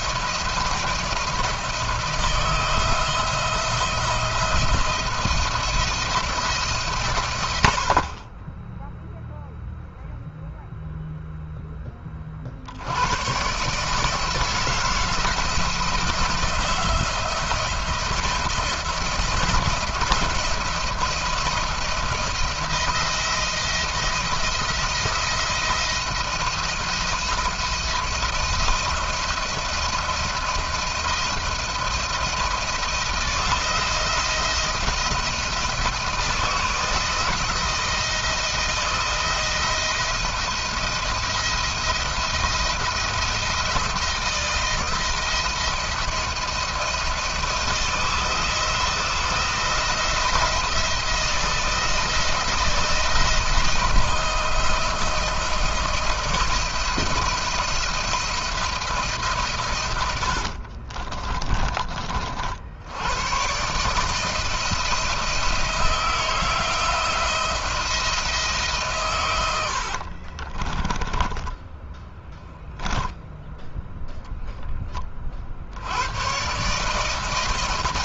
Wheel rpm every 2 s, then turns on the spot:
170, 160, 170, 150, 10, 0, 70, 160, 170, 170, 170, 170, 170, 170, 160, 170, 170, 170, 160, 160, 170, 170, 170, 160, 160, 170, 170, 170, 160, 170, 50, 70, 160, 160, 150, 30, 0, 20, 140.
60-62 70-72